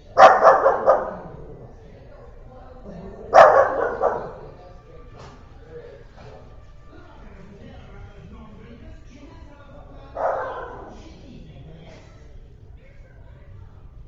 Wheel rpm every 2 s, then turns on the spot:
0, 0, 0, 0, 0, 0, 0.
none